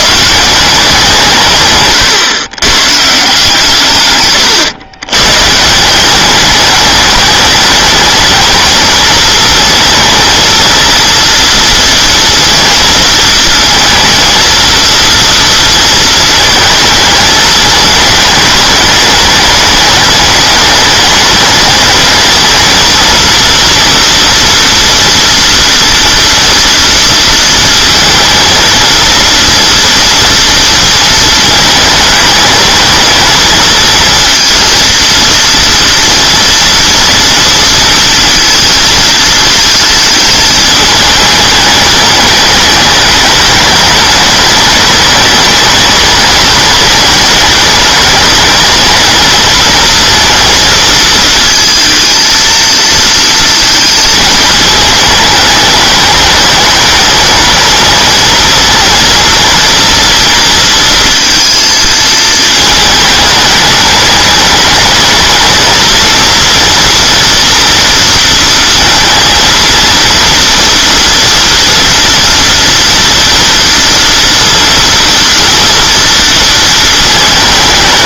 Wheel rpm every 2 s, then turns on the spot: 180, 130, 120, 210, 230, 230, 230, 230, 220, 210, 210, 220, 230, 230, 230, 230, 220, 230, 230, 230, 220, 210, 220, 210, 220, 230, 230, 220, 210, 230, 230, 220, 210, 230, 230, 230, 230, 230, 220.
none